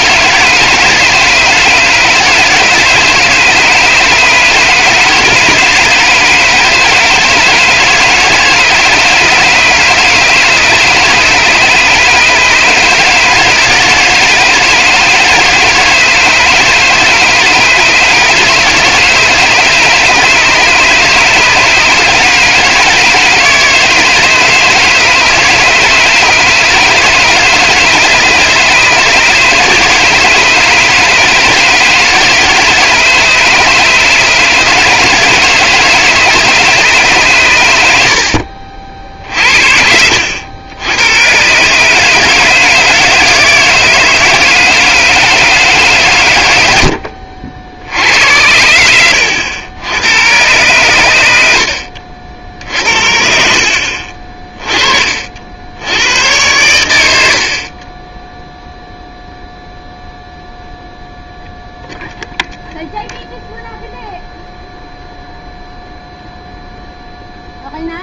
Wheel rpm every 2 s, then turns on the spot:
160, 150, 160, 160, 160, 150, 150, 160, 160, 150, 150, 150, 160, 160, 160, 160, 160, 160, 150, 50, 80, 160, 160, 100, 80, 110, 60, 30, 110, 0, 0, 0, 0, 0.
none